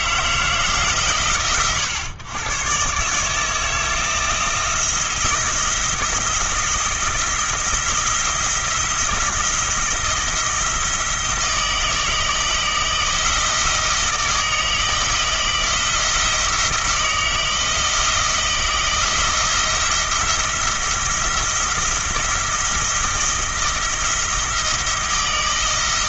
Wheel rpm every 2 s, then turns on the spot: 150, 120, 170, 170, 170, 170, 160, 160, 160, 160, 170, 160, 160.
none